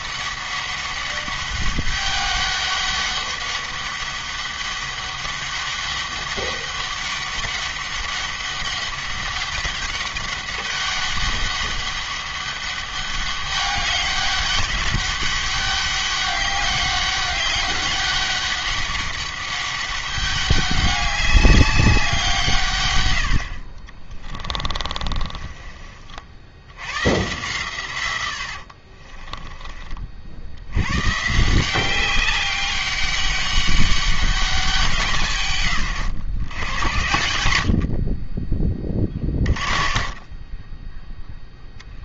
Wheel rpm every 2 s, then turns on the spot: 200, 200, 200, 200, 200, 200, 200, 200, 200, 200, 200, 130, 30, 90, 70, 100, 200, 180, 100, 20, 20.
24-26 28-30